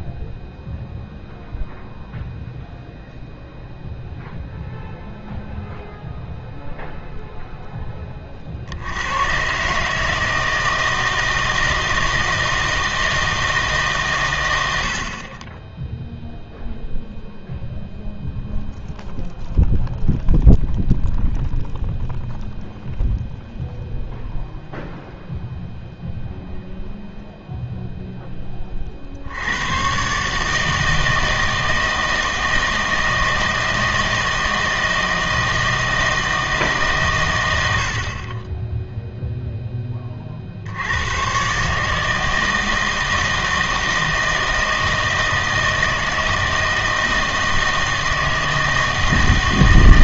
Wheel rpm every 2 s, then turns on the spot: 0, 0, 0, 0, 70, 160, 160, 80, 0, 0, 0, 0, 0, 0, 20, 160, 160, 160, 150, 20, 70, 160, 160, 160, 160.
none